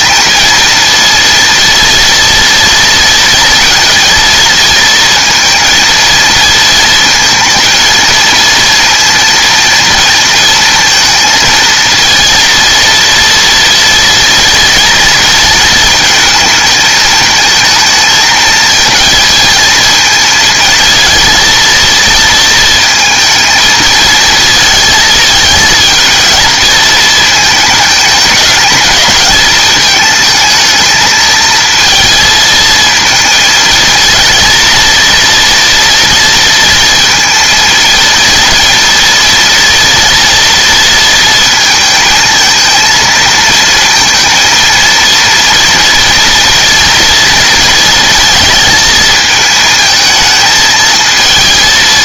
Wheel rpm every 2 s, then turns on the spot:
230, 230, 230, 230, 230, 230, 230, 230, 220, 230, 230, 230, 220, 220, 220, 220, 220, 230, 230, 230, 230, 220, 230, 230, 220, 220.
none